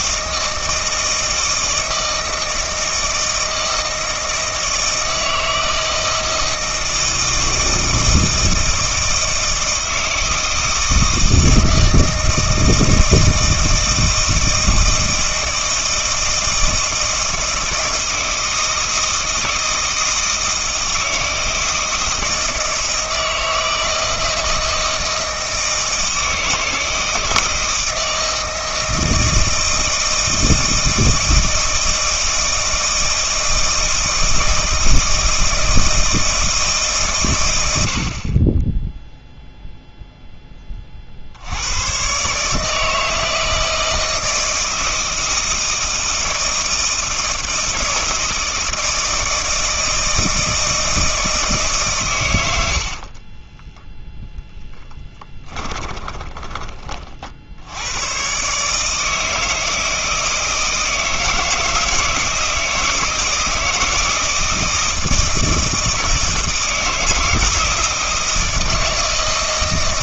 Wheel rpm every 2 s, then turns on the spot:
160, 160, 160, 160, 160, 160, 160, 160, 160, 160, 160, 160, 160, 160, 160, 160, 160, 160, 160, 10, 30, 160, 160, 160, 160, 160, 70, 10, 30, 150, 160, 170, 160, 160, 160.
52-56